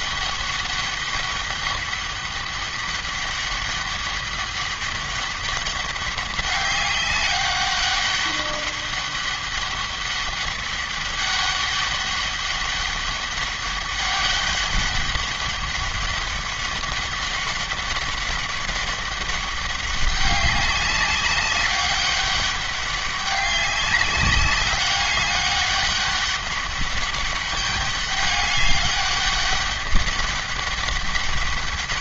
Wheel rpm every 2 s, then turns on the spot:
200, 200, 200, 200, 200, 200, 200, 200, 200, 200, 200, 190, 200, 200, 200, 190.
none